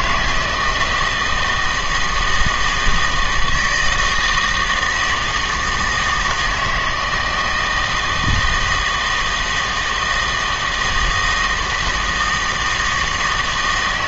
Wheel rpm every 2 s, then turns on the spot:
170, 160, 160, 160, 160, 160, 160.
none